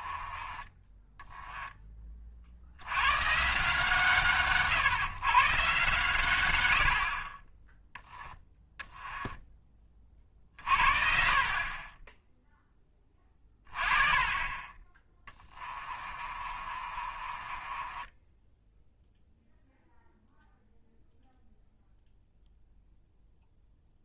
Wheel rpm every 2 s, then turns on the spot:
20, 90, 140, 70, 10, 40, 10, 20, 40, 0, 0, 0.
8-10 16-18